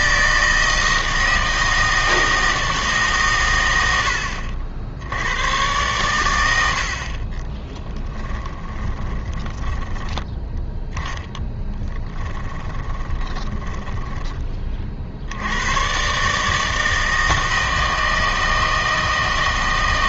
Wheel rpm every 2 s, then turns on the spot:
160, 160, 70, 80, 20, 10, 20, 30, 160, 160.
8-10 12-14